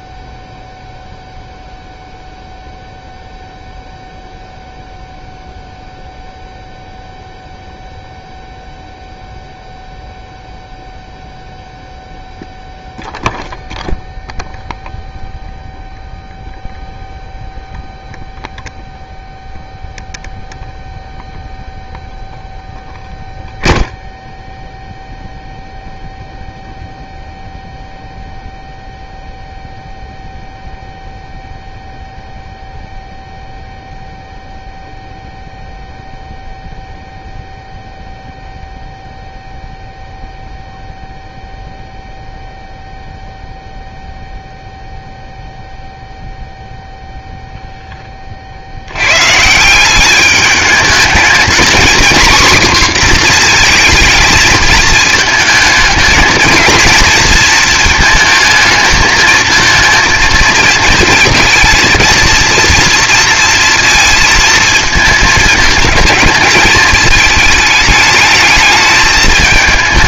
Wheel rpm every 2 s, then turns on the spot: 0, 0, 0, 0, 0, 0, 0, 0, 0, 0, 0, 0, 0, 0, 0, 0, 0, 0, 0, 0, 0, 0, 0, 0, 60, 200, 250, 220, 230, 220, 230, 230, 230, 220, 220.
none